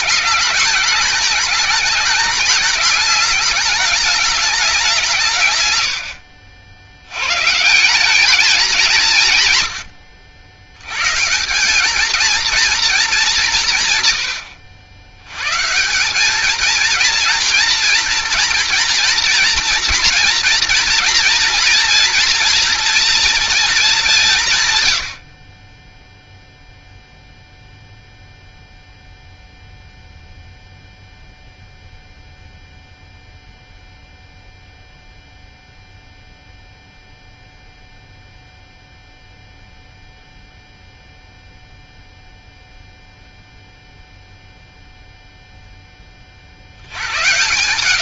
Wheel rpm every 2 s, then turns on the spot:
210, 210, 200, 70, 200, 80, 230, 90, 210, 230, 240, 230, 150, 0, 0, 0, 0, 0, 0, 0, 0, 0, 0, 50.
none